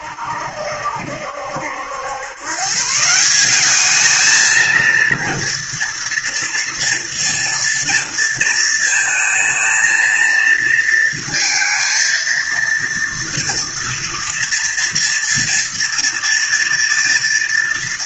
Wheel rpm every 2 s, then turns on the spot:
70, 120, 220, 230, 230, 230, 230, 230, 230.
none